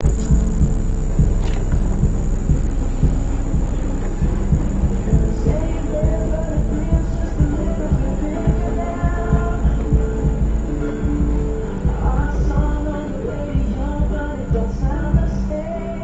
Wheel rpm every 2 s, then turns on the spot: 0, 0, 0, 0, 0, 0, 0, 0.
none